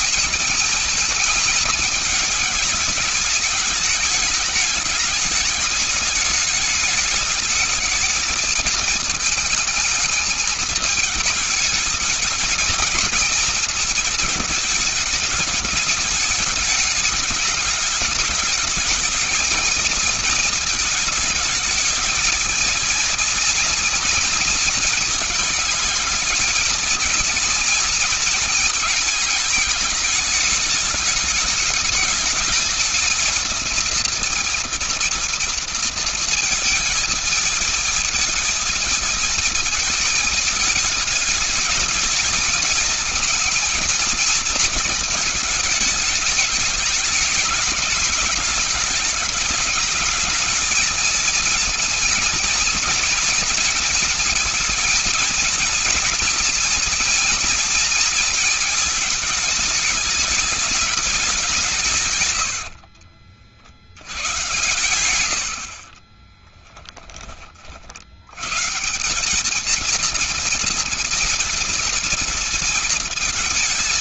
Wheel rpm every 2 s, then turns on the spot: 230, 210, 210, 210, 220, 220, 210, 220, 210, 210, 220, 220, 230, 220, 230, 210, 210, 230, 230, 220, 220, 220, 230, 210, 200, 210, 230, 230, 230, 230, 210, 130, 90, 20, 80, 230, 230.
62-64 66-68